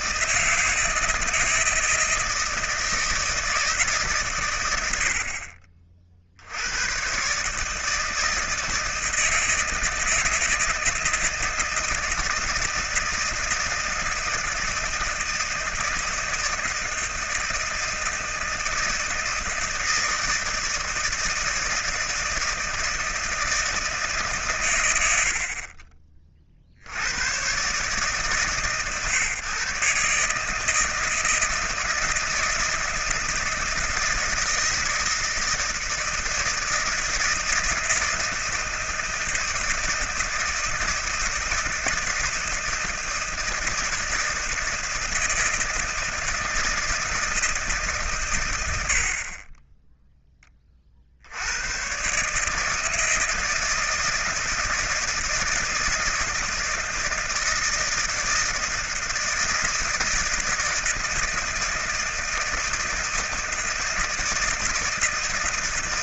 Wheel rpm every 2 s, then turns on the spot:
160, 160, 100, 90, 160, 160, 160, 160, 160, 160, 160, 160, 110, 70, 140, 160, 160, 160, 160, 160, 160, 160, 160, 160, 90, 30, 150, 170, 160, 160, 160, 160, 160.
none